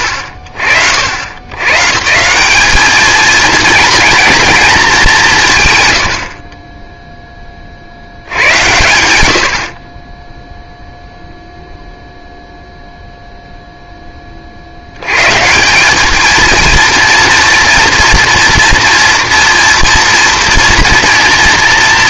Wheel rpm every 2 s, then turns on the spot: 70, 210, 220, 30, 110, 0, 0, 60, 230, 230, 230.
none